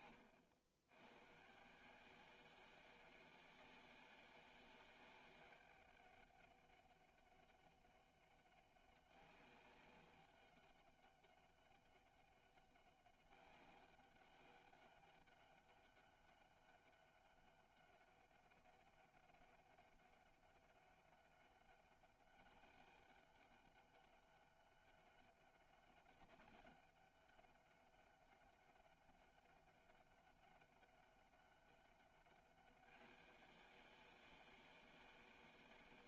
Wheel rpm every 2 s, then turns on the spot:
90, 190, 200, 200, 200, 200, 200, 200, 200, 200, 200, 200, 200, 200, 200, 200, 200, 200.
none